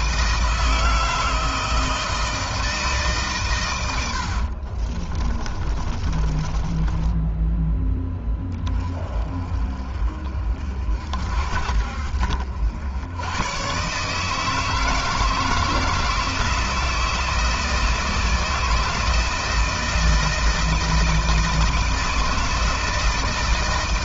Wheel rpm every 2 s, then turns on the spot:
160, 160, 60, 20, 20, 50, 70, 160, 160, 160, 160, 160.
4-8